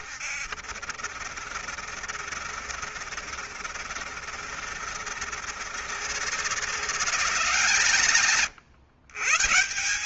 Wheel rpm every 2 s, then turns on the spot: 70, 70, 70, 160, 120.
none